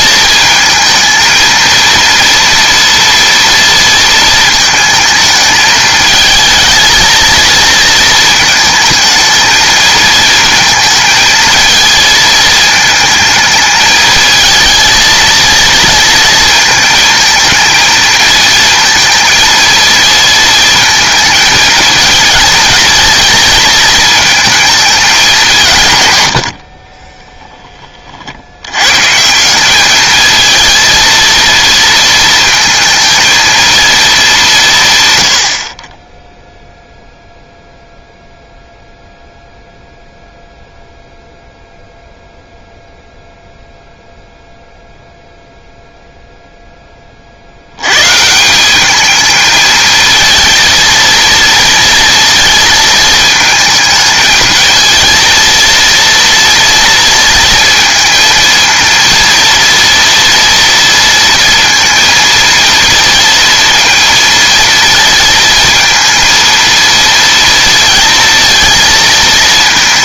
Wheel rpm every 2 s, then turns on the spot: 220, 230, 220, 220, 220, 220, 220, 220, 220, 220, 220, 220, 220, 60, 90, 220, 220, 170, 0, 0, 0, 0, 0, 0, 190, 230, 230, 220, 230, 230, 230, 230, 230, 230, 230.
26-28